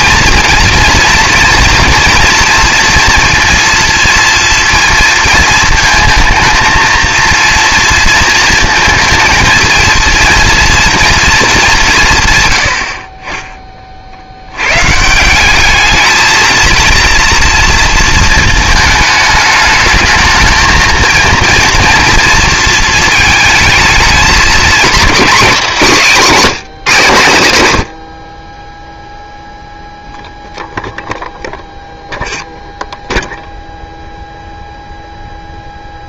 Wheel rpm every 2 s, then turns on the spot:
230, 230, 230, 230, 230, 230, 70, 130, 230, 220, 220, 220, 230, 170, 10, 0, 0, 0.
none